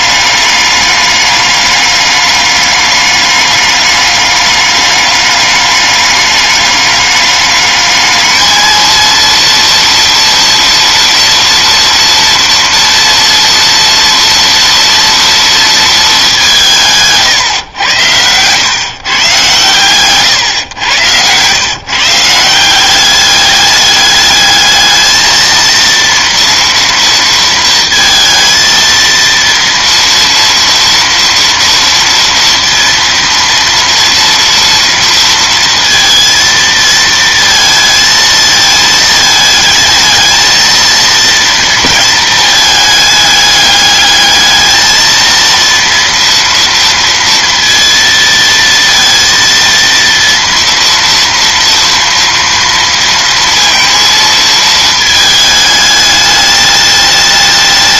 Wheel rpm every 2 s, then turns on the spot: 200, 200, 200, 210, 230, 230, 230, 230, 160, 140, 110, 190, 220, 230, 230, 230, 230, 230, 230, 220, 230, 210, 220, 230, 230, 230, 230, 220, 210.
none